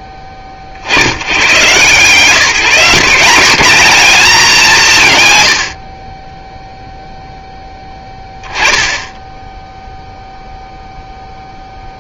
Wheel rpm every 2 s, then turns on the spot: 70, 180, 190, 0, 20, 0.
none